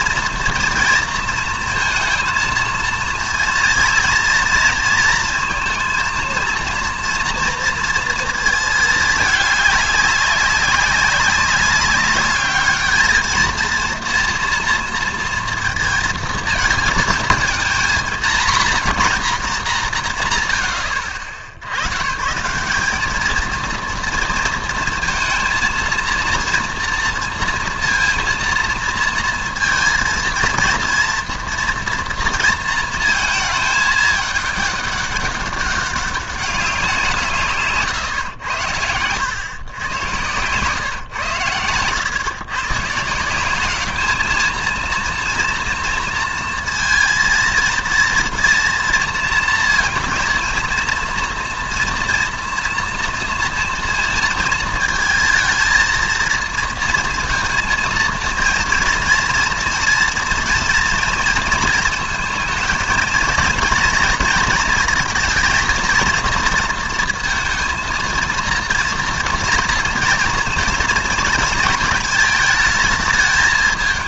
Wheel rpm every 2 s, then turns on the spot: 230, 230, 230, 230, 220, 200, 210, 230, 220, 150, 100, 200, 230, 230, 230, 230, 230, 210, 180, 110, 130, 130, 230, 230, 230, 230, 230, 220, 230, 230, 230, 220, 230, 230, 230, 230, 210.
38-40